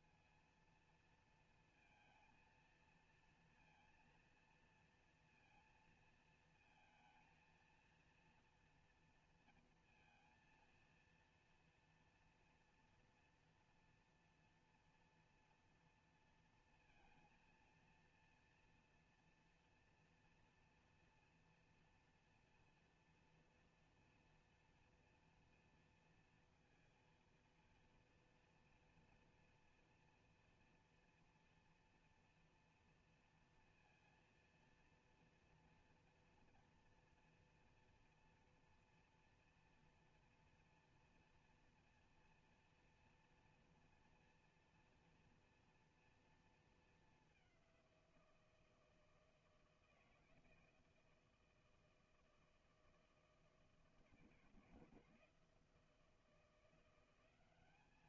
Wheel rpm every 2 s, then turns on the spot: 230, 230, 230, 230, 230, 230, 230, 240, 230, 230, 230, 230, 240, 230, 230, 230, 240, 230, 230, 230, 230, 240, 230, 230, 170, 160, 160, 160, 170.
none